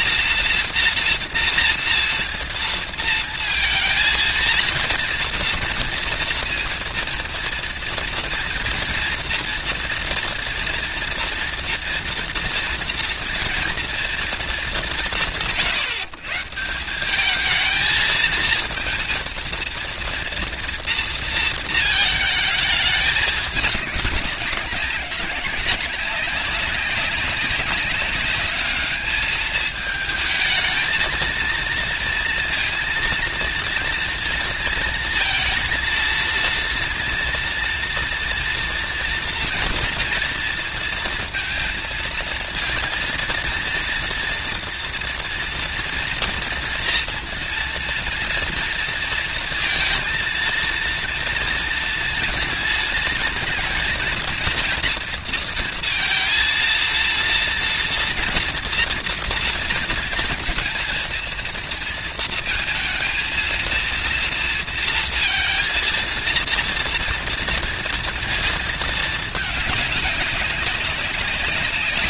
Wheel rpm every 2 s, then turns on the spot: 230, 230, 230, 230, 230, 230, 240, 220, 160, 230, 230, 220, 190, 200, 200, 220, 230, 230, 230, 230, 230, 230, 230, 230, 230, 230, 230, 230, 230, 230, 230, 230, 230, 230, 230, 200.
none